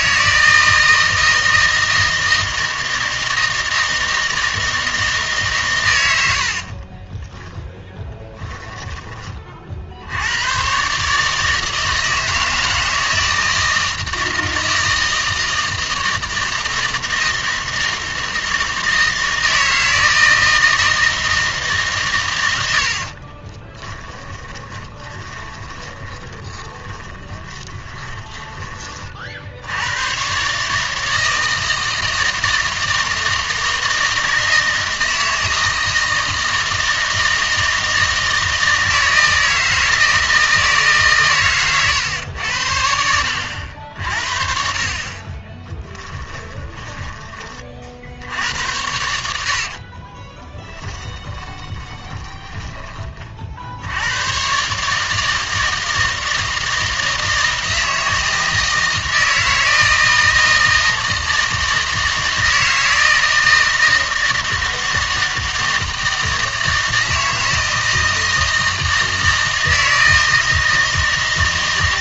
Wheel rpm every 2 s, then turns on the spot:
160, 160, 160, 30, 10, 130, 160, 160, 160, 160, 160, 80, 20, 10, 30, 150, 160, 160, 160, 160, 150, 80, 50, 20, 100, 10, 20, 140, 160, 160, 160, 160, 160, 160, 160, 160.
6-8 22-28 46-48 50-52